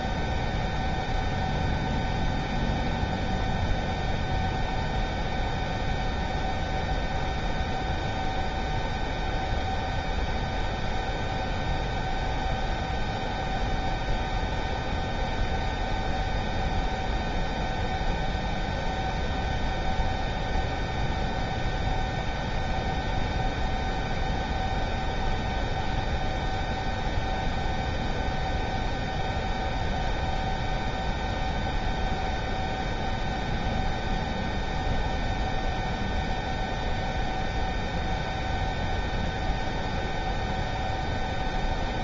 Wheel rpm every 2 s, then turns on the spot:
0, 0, 0, 0, 0, 0, 0, 0, 0, 0, 0, 0, 0, 0, 0, 0, 0, 0, 0, 0, 0.
none